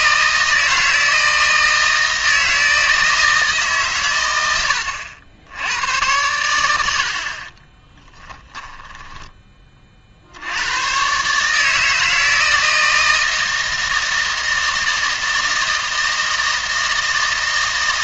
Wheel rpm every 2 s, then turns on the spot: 160, 160, 90, 90, 10, 110, 160, 160, 160.
8-10